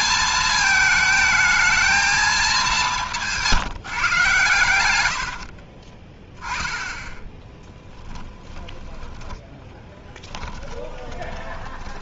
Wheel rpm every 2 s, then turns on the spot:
220, 160, 70, 10, 20, 20.
4-6 8-12